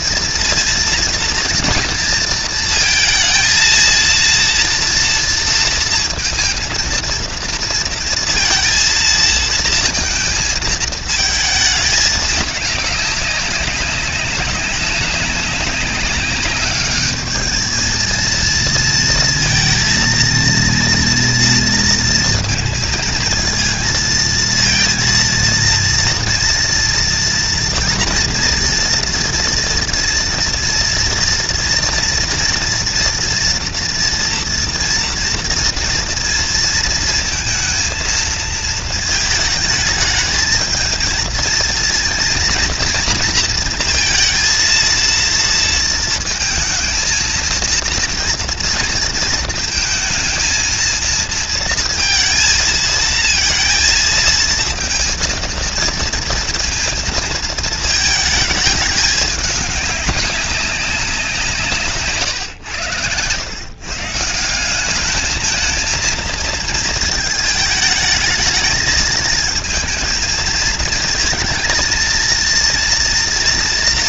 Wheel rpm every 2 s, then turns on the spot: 230, 230, 230, 230, 220, 230, 200, 190, 210, 230, 230, 230, 230, 230, 240, 240, 230, 230, 230, 220, 230, 230, 230, 230, 230, 230, 230, 230, 220, 210, 190, 100, 210, 220, 220, 220, 240.
none